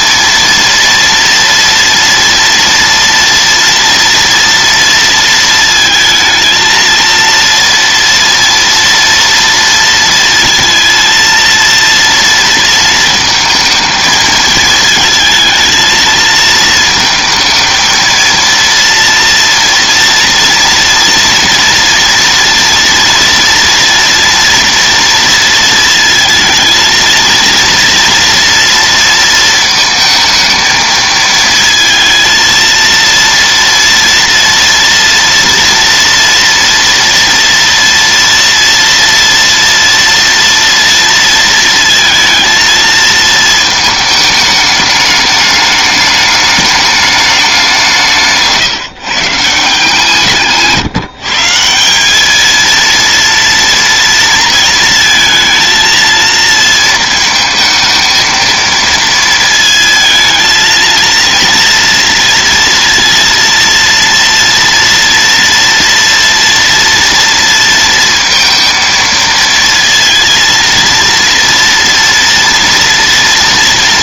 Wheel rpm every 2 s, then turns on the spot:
230, 230, 230, 230, 230, 230, 230, 220, 220, 230, 240, 230, 230, 220, 230, 220, 230, 230, 230, 230, 230, 230, 210, 210, 140, 160, 230, 230, 230, 230, 230, 230, 230, 230, 230, 230, 230.
none